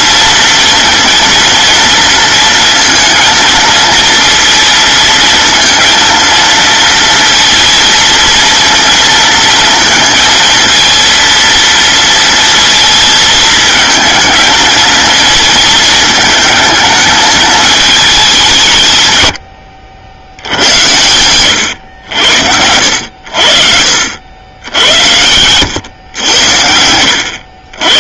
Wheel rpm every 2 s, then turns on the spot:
230, 230, 230, 230, 230, 230, 230, 220, 220, 170, 90, 80, 80, 90.
none